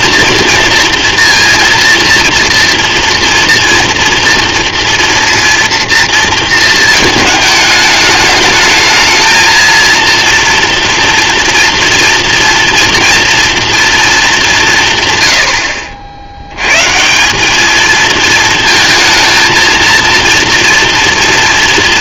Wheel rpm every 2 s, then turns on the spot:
230, 230, 230, 220, 210, 230, 230, 170, 100, 230, 230.
none